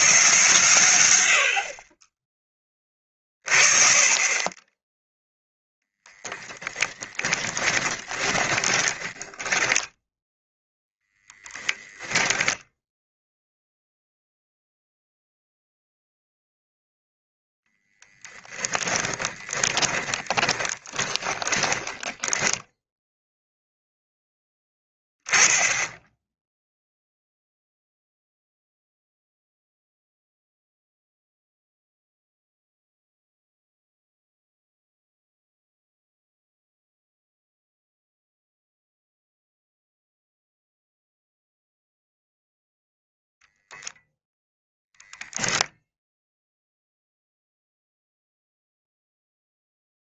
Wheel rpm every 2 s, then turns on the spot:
130, 20, 10, 10, 10, 0, 0, 0, 0, 20, 10, 10, 10, 0, 0, 0, 0, 0, 0, 0, 0, 0, 0, 0, 0.
6-10 18-24